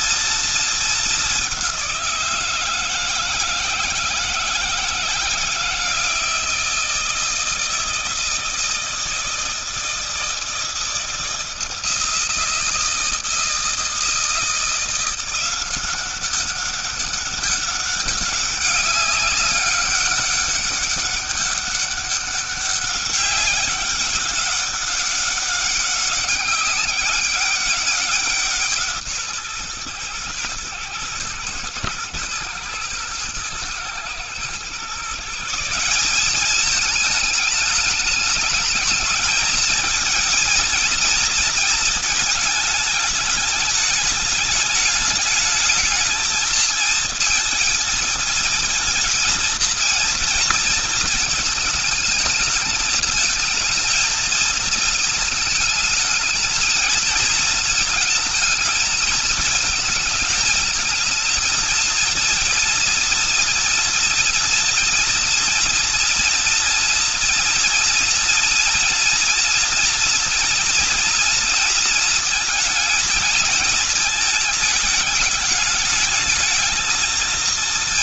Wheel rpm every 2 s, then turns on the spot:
230, 170, 160, 160, 160, 160, 160, 170, 190, 200, 200, 200, 190, 200, 170, 120, 120, 120, 200, 210, 230, 220, 210, 230, 230, 230, 220, 220, 220, 220, 220, 230, 230, 240, 230, 230, 220, 220, 210.
none